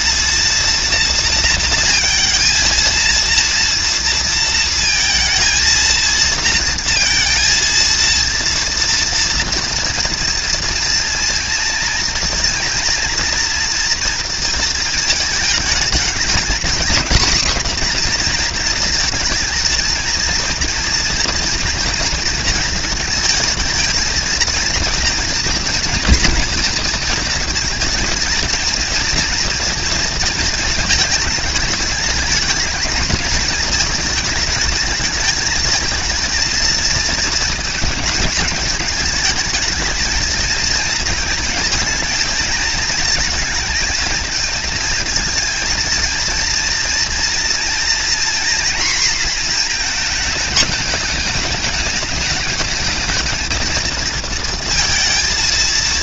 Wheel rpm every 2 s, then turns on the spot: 230, 230, 230, 230, 230, 230, 230, 230, 220, 230, 240, 230, 230, 230, 230, 220, 220, 210, 220, 210, 230, 220, 220, 230, 230, 210, 220, 230.
none